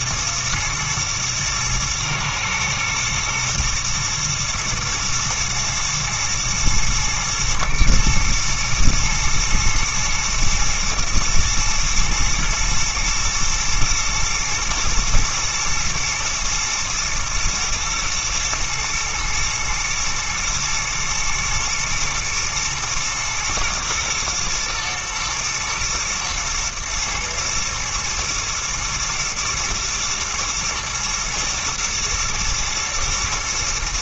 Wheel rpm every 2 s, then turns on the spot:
110, 120, 120, 110, 110, 110, 110, 120, 120, 120, 110, 110, 120, 110, 110, 110, 110.
none